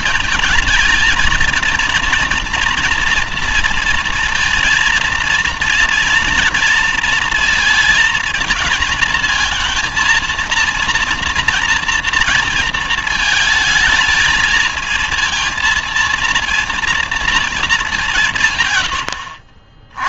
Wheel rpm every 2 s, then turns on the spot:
220, 240, 230, 230, 230, 230, 230, 220, 230, 130.
none